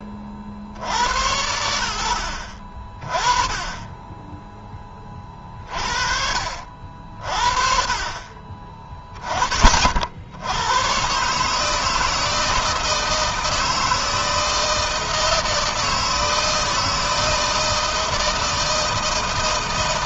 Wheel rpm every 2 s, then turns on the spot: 60, 50, 20, 40, 40, 100, 160, 160, 160, 160.
none